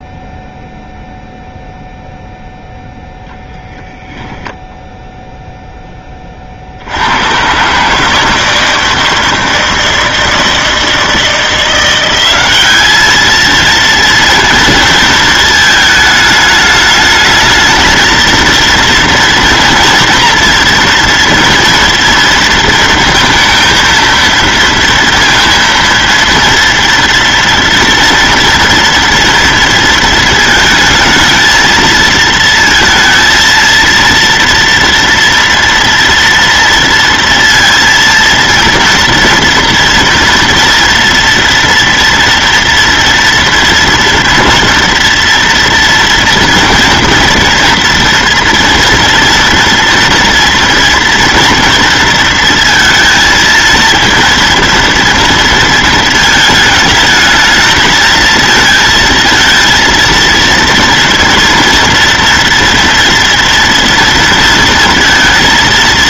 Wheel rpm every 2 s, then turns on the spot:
0, 0, 0, 60, 160, 160, 200, 230, 210, 230, 230, 230, 230, 230, 230, 220, 230, 230, 230, 230, 240, 230, 230, 230, 230, 230, 230, 230, 220, 220, 230, 230, 230.
none